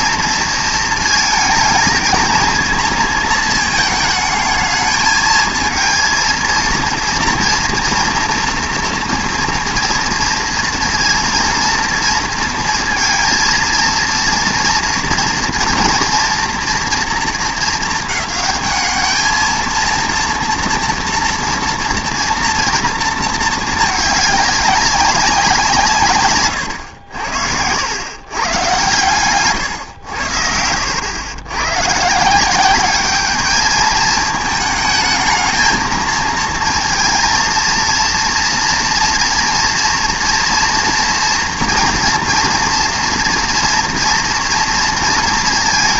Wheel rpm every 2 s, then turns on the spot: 230, 220, 220, 230, 230, 230, 230, 230, 230, 210, 230, 230, 200, 100, 130, 90, 200, 220, 220, 240, 230, 230, 230.
none